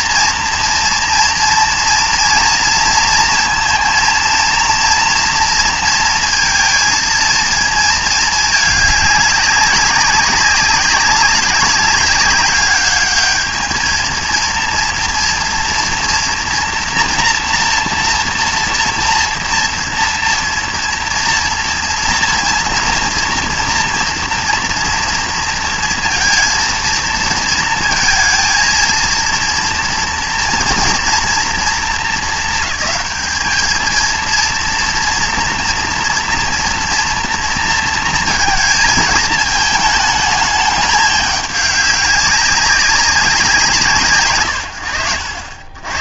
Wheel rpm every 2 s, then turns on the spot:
230, 230, 230, 230, 210, 200, 200, 230, 240, 230, 240, 230, 230, 230, 230, 230, 220, 230, 240, 220, 210, 190, 80.
none